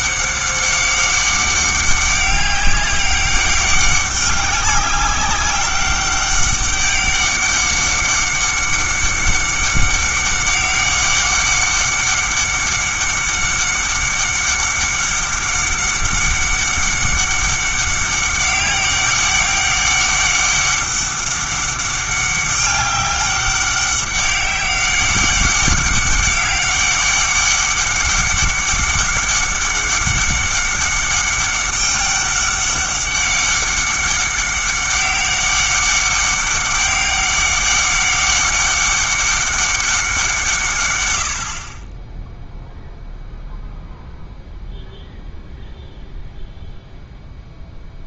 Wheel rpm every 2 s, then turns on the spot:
200, 200, 200, 200, 200, 190, 200, 200, 190, 200, 190, 190, 190, 190, 200, 200, 200, 200, 200, 200, 130, 0, 0, 0.
none